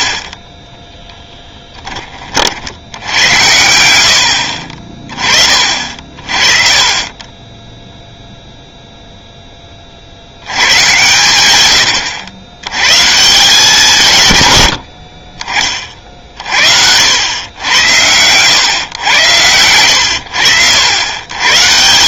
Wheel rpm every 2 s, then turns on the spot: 10, 70, 50, 40, 0, 100, 110, 90, 60, 110, 90.
0-2